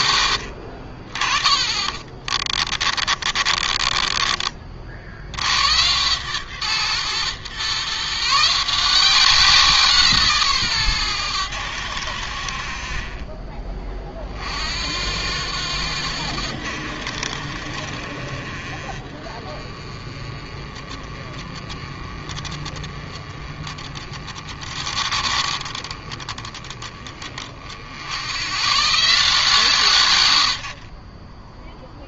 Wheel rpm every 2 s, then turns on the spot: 60, 30, 50, 130, 170, 140, 60, 60, 70, 40, 30, 30, 30, 20, 110, 80.
0-4